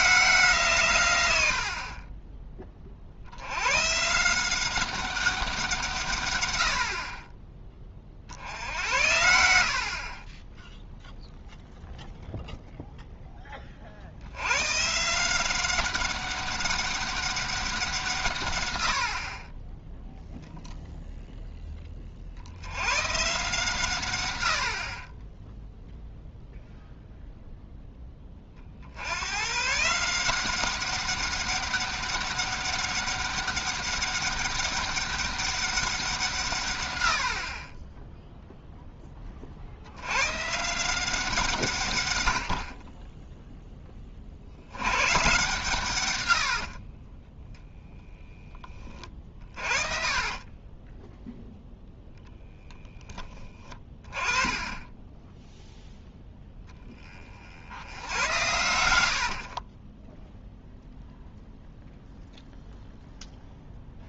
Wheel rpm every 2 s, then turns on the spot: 140, 30, 190, 80, 70, 0, 0, 130, 200, 100, 0, 90, 60, 0, 50, 190, 200, 200, 120, 0, 160, 50, 90, 70, 20, 20, 10, 20, 10, 90, 0, 0.
46-48 50-52 54-56 58-60